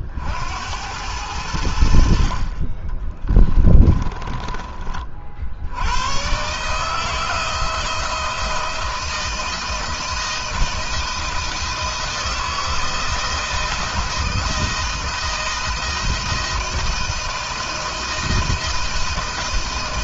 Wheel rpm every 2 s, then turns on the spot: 90, 30, 30, 150, 160, 160, 160, 160, 170, 160.
2-4